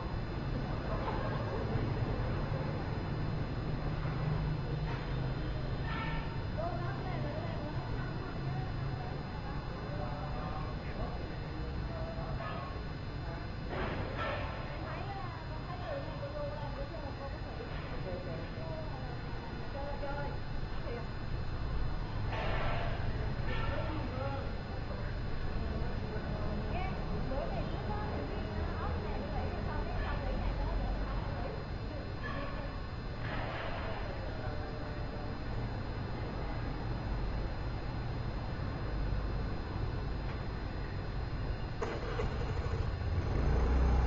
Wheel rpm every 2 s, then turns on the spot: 0, 0, 0, 0, 0, 0, 0, 0, 0, 0, 0, 0, 0, 0, 0, 0, 0, 0, 0, 0, 0, 0.
none